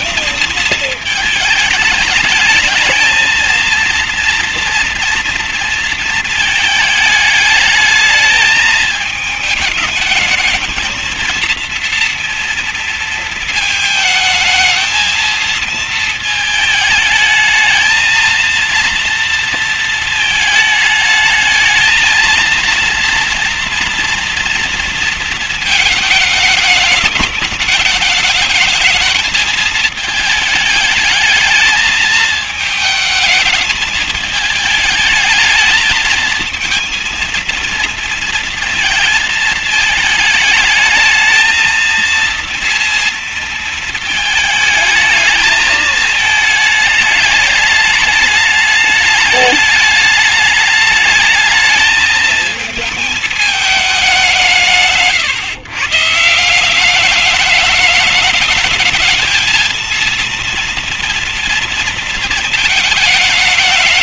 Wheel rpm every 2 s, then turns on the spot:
220, 220, 230, 220, 210, 220, 230, 220, 220, 230, 220, 230, 230, 210, 220, 220, 220, 210, 220, 230, 220, 230, 220, 220, 210, 210, 220, 190, 170, 220, 230, 230.
none